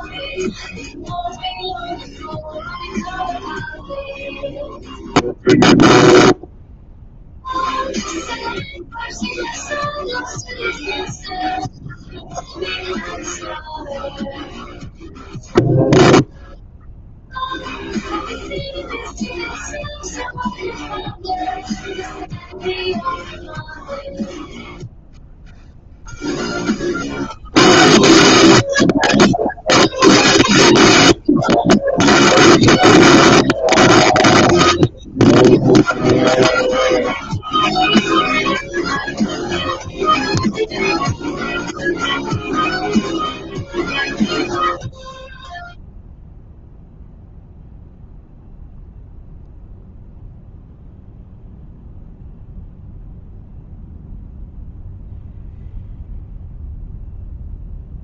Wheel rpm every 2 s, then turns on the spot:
0, 0, 0, 0, 0, 0, 0, 0, 0, 0, 0, 0, 0, 0, 0, 0, 0, 0, 0, 0, 0, 0, 0, 0, 0, 0, 0, 0, 0.
none